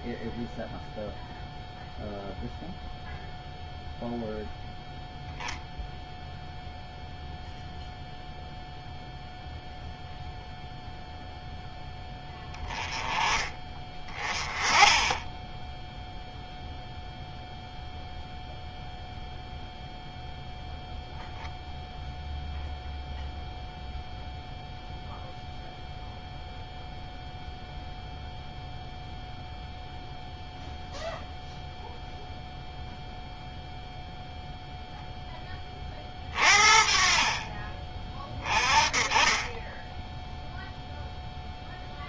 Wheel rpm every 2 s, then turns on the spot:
0, 0, 0, 0, 0, 0, 10, 20, 0, 0, 0, 0, 0, 0, 0, 0, 0, 0, 40, 30, 0.
none